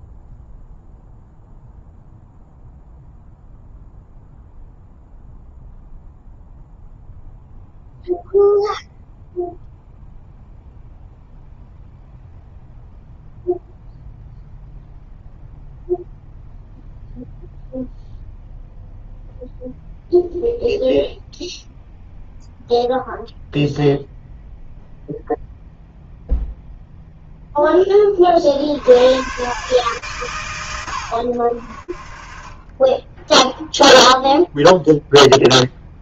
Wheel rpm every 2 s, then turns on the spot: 0, 0, 0, 0, 0, 0, 0, 0, 0, 0, 0, 0, 0, 40, 130, 30, 0, 0.
none